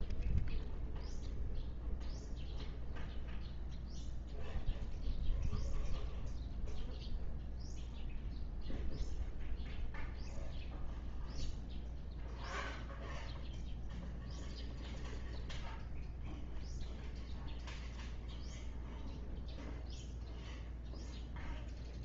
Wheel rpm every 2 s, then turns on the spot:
0, 0, 0, 0, 0, 0, 0, 0, 0, 0, 0.
none